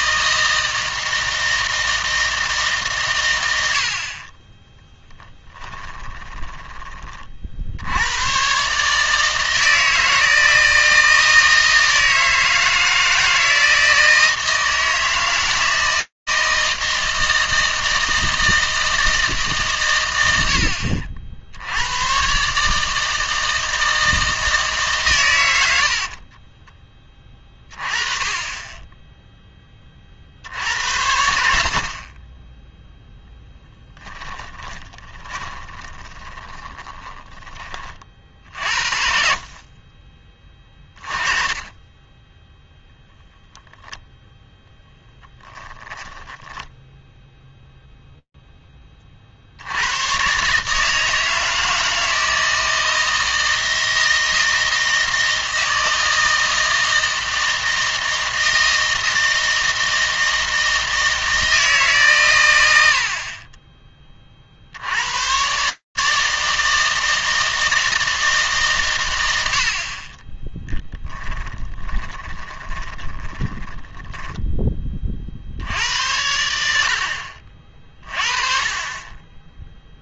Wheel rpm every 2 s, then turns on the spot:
160, 150, 10, 20, 140, 160, 160, 160, 160, 160, 50, 150, 150, 20, 10, 80, 10, 20, 20, 50, 30, 0, 10, 0, 30, 160, 160, 160, 160, 160, 160, 80, 70, 160, 120, 10, 20, 30, 90, 30.
4-8 26-28 34-38 44-46 70-74